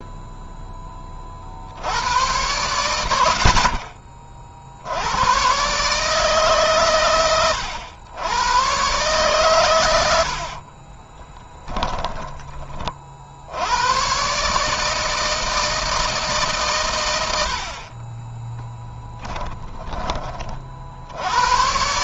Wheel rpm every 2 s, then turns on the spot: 20, 80, 90, 120, 120, 30, 50, 160, 100, 10, 70.
10-12 18-20